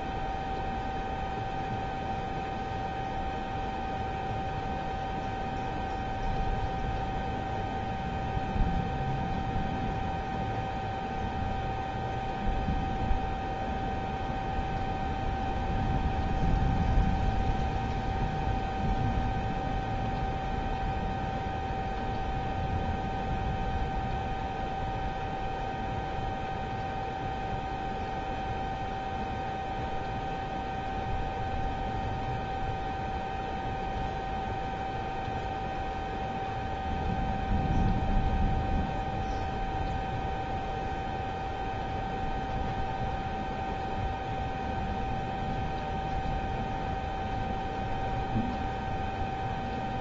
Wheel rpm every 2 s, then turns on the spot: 0, 0, 0, 0, 0, 0, 0, 0, 0, 0, 0, 0, 0, 0, 0, 0, 0, 0, 0, 0, 0, 0, 0, 0, 0.
none